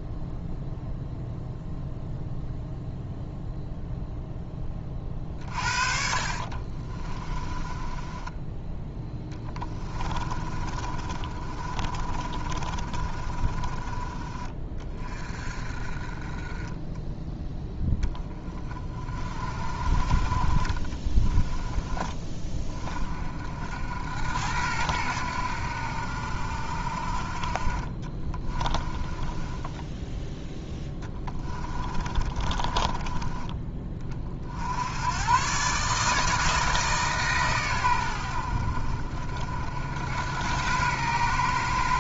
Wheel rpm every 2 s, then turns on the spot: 0, 0, 20, 40, 10, 30, 30, 30, 20, 20, 30, 30, 90, 60, 20, 10, 20, 70, 160, 60, 100.
6-8 10-14 28-34